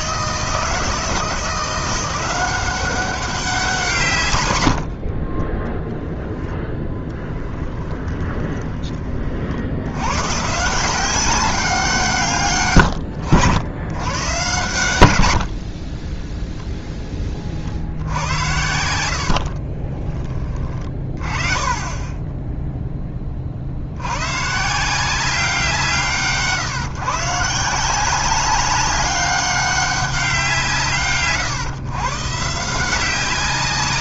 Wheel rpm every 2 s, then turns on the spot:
160, 190, 80, 10, 20, 160, 110, 110, 0, 80, 20, 10, 150, 140, 190, 160, 160.
4-8